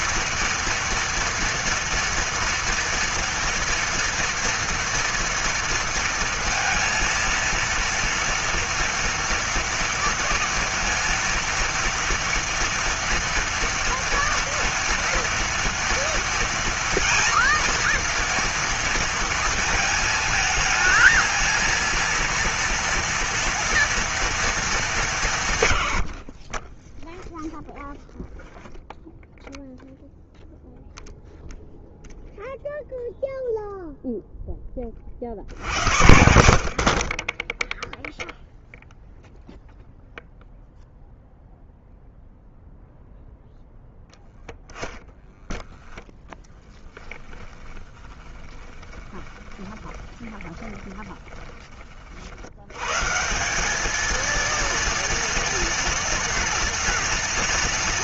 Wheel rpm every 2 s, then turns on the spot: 240, 230, 230, 230, 230, 230, 230, 230, 230, 230, 220, 230, 230, 40, 0, 0, 0, 0, 70, 0, 0, 0, 10, 10, 20, 20, 80, 230, 240.
44-46 48-52